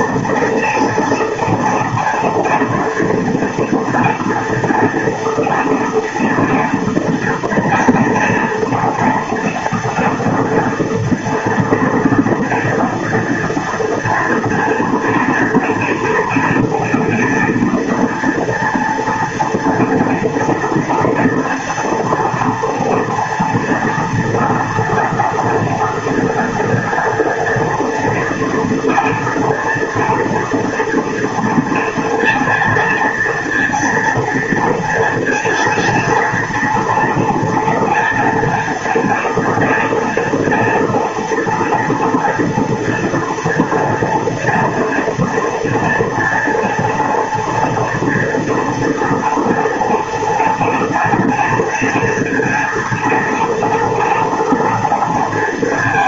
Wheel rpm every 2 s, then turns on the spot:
230, 230, 230, 230, 240, 230, 230, 230, 230, 230, 230, 230, 240, 240, 230, 230, 230, 230, 240, 240, 230, 240, 230, 230, 230, 230, 230, 230.
none